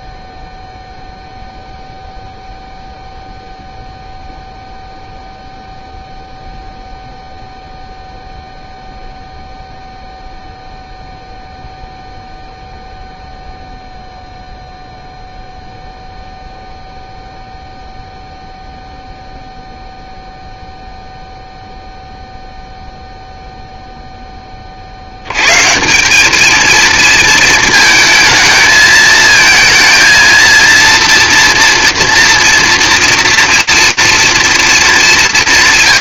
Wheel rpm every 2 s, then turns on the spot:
0, 0, 0, 0, 0, 0, 0, 0, 0, 0, 0, 0, 80, 230, 220, 230, 240, 200.
none